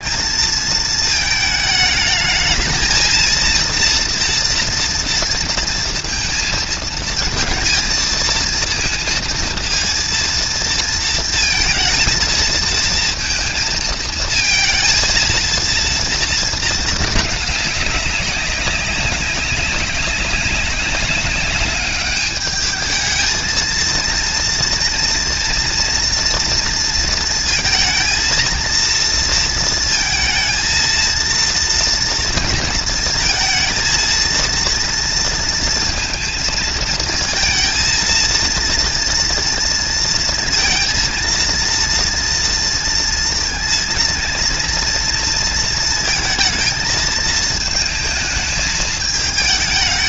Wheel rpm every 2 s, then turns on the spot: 220, 230, 230, 230, 230, 230, 230, 230, 220, 200, 200, 210, 230, 230, 230, 230, 230, 230, 220, 230, 230, 230, 230, 220, 210.
none